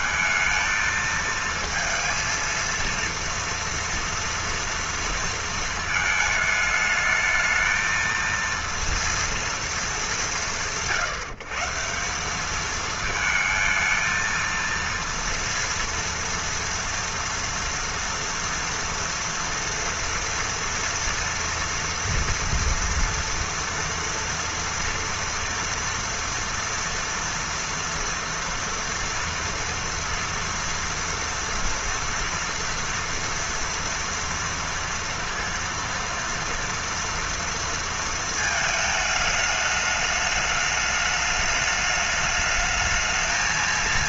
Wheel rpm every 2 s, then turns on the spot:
220, 230, 230, 220, 230, 130, 210, 230, 230, 230, 230, 230, 230, 230, 230, 240, 230, 230, 230, 220, 210, 210.
none